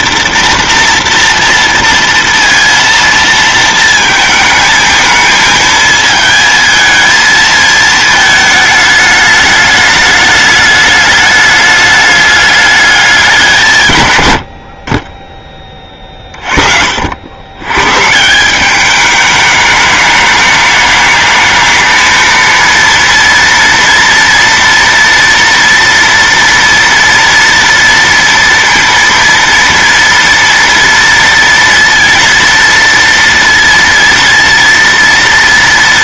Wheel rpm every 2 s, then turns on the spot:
230, 230, 220, 220, 220, 210, 210, 80, 40, 190, 210, 230, 240, 240, 230, 230, 230, 230.
none